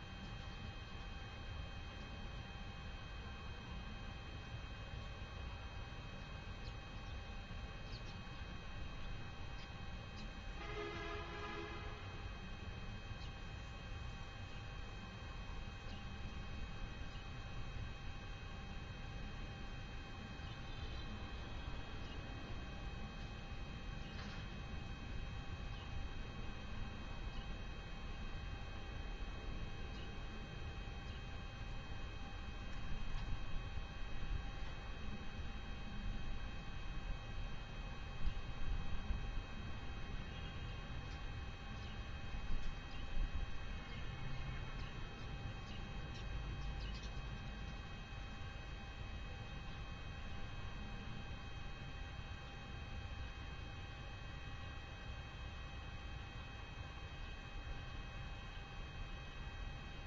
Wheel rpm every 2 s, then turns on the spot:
0, 0, 0, 0, 0, 0, 0, 0, 0, 0, 0, 0, 0, 0, 0, 0, 0, 0, 0, 0, 0, 0, 0, 0, 0, 0, 0, 0, 0, 0.
none